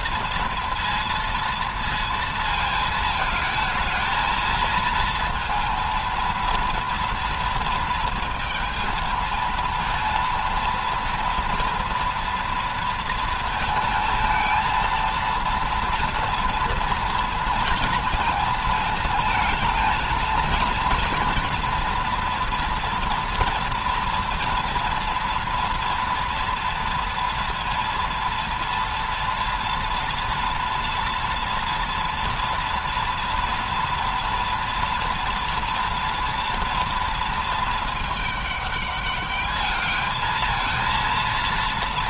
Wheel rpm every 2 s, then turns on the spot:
240, 220, 220, 230, 230, 230, 230, 220, 230, 220, 230, 240, 230, 230, 230, 230, 230, 230, 230, 210, 220.
none